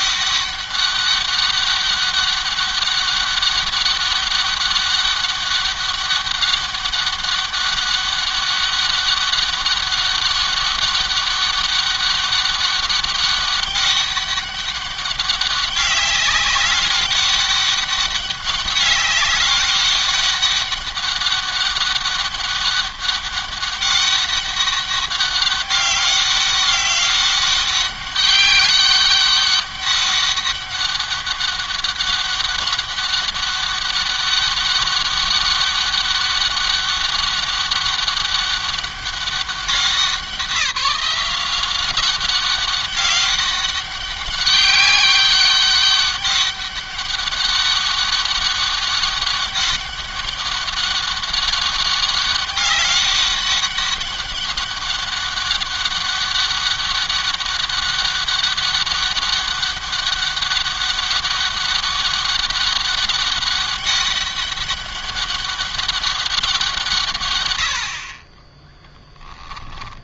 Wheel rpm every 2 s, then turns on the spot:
200, 200, 200, 200, 200, 200, 200, 200, 190, 200, 200, 200, 200, 200, 200, 200, 200, 200, 200, 200, 190, 190, 200, 200, 190, 200, 200, 200, 200, 200, 200, 200, 200, 180, 30.
68-70